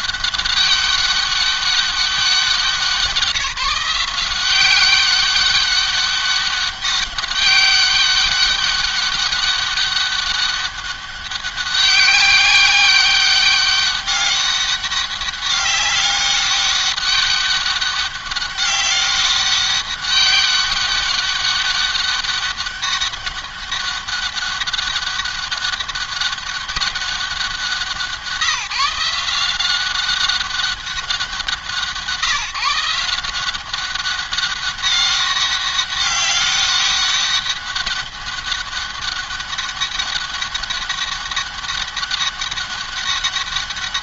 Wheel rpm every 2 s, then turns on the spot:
200, 180, 190, 200, 200, 190, 190, 200, 200, 200, 200, 200, 200, 200, 180, 190, 160, 200, 200, 200, 200, 200.
none